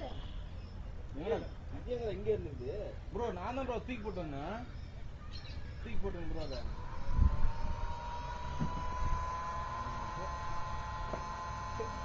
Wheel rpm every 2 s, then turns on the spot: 0, 0, 0, 0, 0, 0.
none